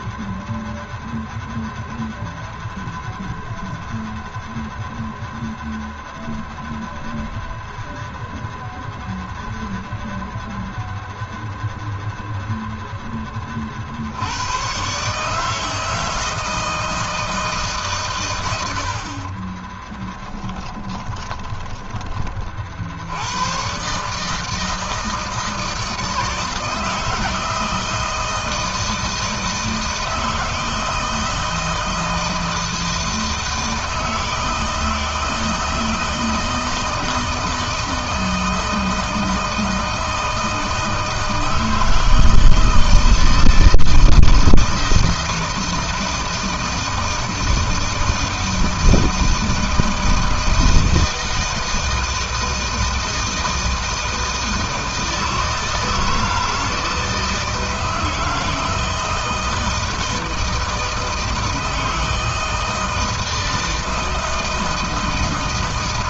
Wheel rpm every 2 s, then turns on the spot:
0, 0, 0, 0, 0, 0, 0, 90, 160, 100, 10, 40, 150, 160, 160, 160, 160, 160, 160, 160, 160, 160, 160, 160, 160, 160, 160, 160, 160, 160, 160, 160, 160.
20-22